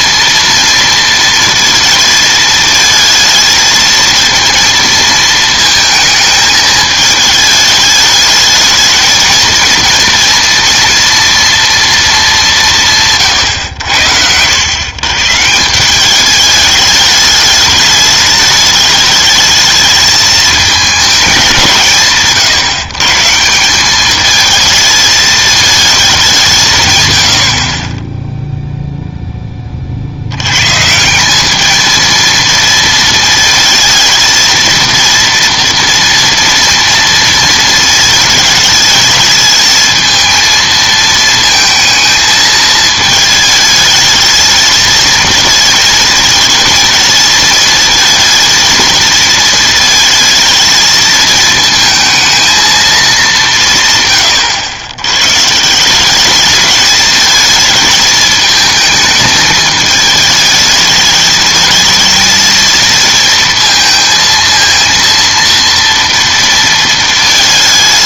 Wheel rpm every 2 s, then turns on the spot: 230, 220, 230, 220, 220, 230, 180, 100, 210, 210, 210, 140, 220, 150, 0, 130, 230, 230, 230, 220, 220, 220, 220, 220, 230, 220, 230, 100, 210, 220, 210, 230, 230, 230.
none